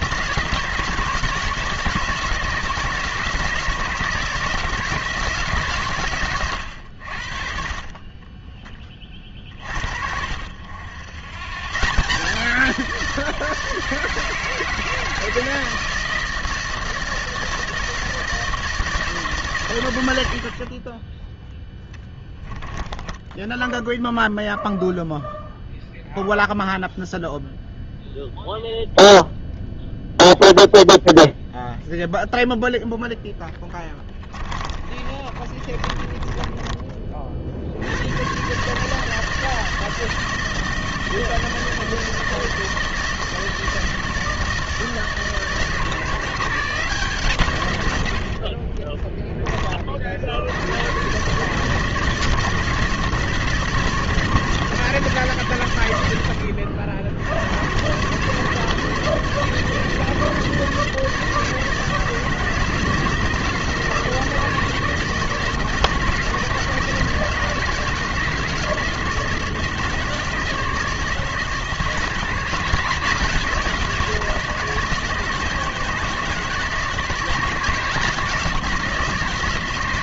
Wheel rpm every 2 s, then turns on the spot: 170, 160, 160, 90, 20, 80, 170, 160, 160, 160, 50, 20, 0, 0, 0, 0, 0, 30, 20, 150, 160, 160, 160, 160, 40, 90, 160, 160, 70, 160, 160, 160, 160, 160, 160, 160, 170, 160, 160, 170.
22-24 34-38 48-50